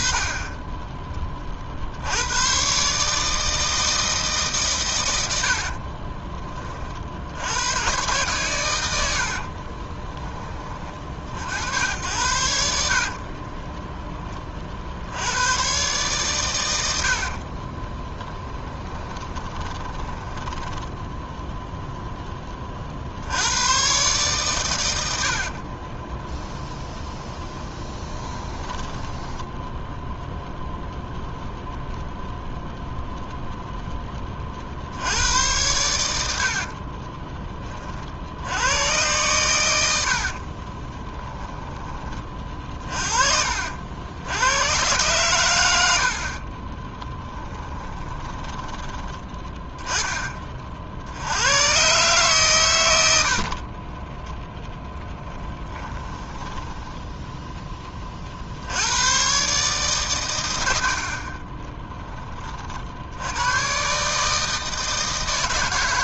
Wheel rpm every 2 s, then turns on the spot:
20, 130, 120, 40, 100, 40, 60, 60, 90, 30, 10, 40, 110, 20, 20, 0, 0, 60, 40, 110, 30, 40, 100, 20, 10, 50, 100, 0, 10, 90, 70, 50, 160.
12-14 18-22 26-30 36-38 40-42 46-48 56-58 60-62